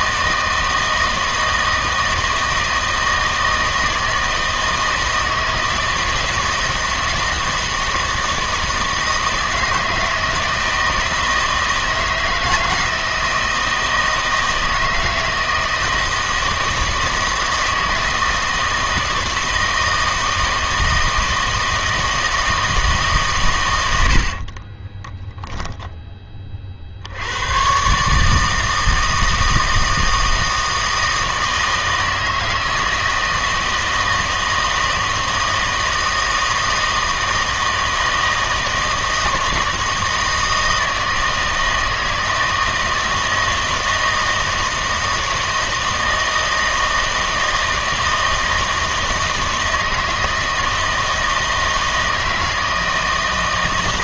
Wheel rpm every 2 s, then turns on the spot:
160, 160, 160, 160, 160, 160, 160, 160, 160, 160, 160, 160, 30, 40, 160, 160, 160, 160, 160, 160, 160, 160, 160, 160, 160, 160, 160.
24-26